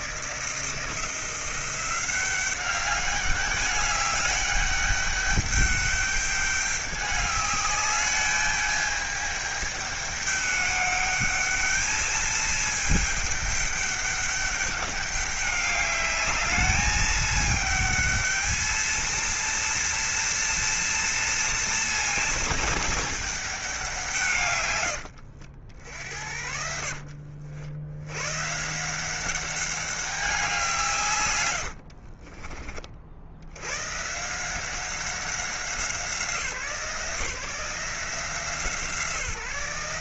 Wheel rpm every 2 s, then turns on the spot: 170, 200, 200, 200, 210, 210, 220, 200, 210, 230, 230, 220, 100, 60, 170, 150, 50, 190, 170, 160.
26-28